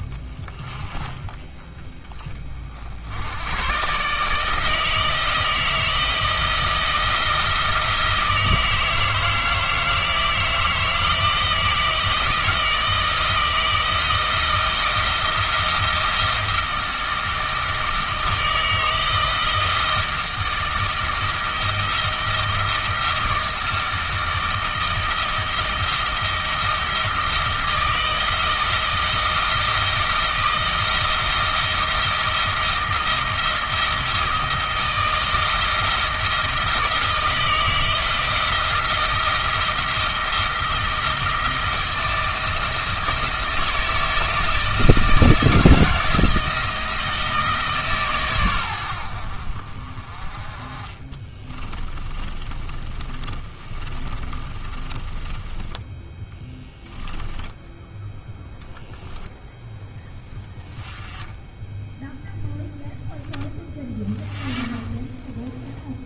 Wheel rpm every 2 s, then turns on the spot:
30, 40, 160, 170, 160, 160, 160, 160, 160, 160, 160, 160, 170, 160, 160, 170, 160, 160, 160, 160, 160, 160, 160, 160, 100, 30, 20, 20, 10, 0, 10, 10, 10.
52-58